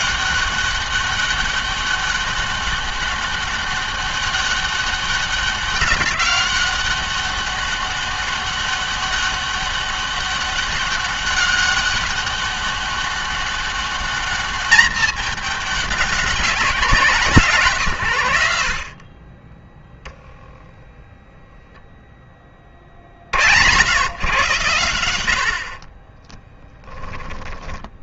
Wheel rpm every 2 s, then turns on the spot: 200, 200, 190, 190, 200, 200, 200, 210, 190, 80, 0, 30, 110, 10.
26-28